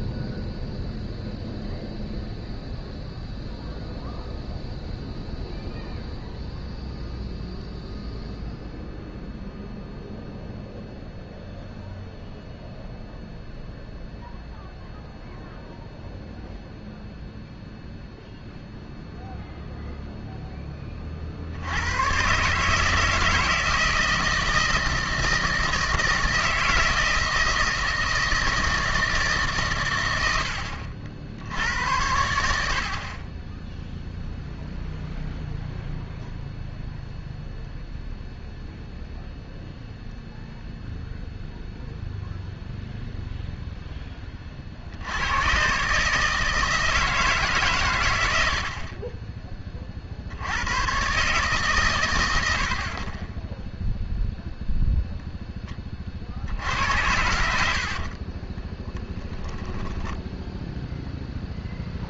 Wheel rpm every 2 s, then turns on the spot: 0, 0, 0, 0, 0, 0, 0, 0, 0, 0, 30, 150, 160, 160, 160, 70, 50, 0, 0, 0, 0, 0, 70, 160, 40, 110, 50, 0, 80, 30, 0.
58-60